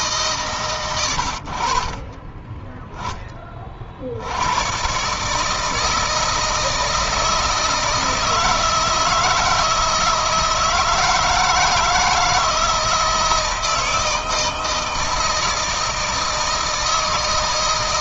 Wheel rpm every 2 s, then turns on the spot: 100, 20, 110, 160, 160, 160, 160, 160, 160.
none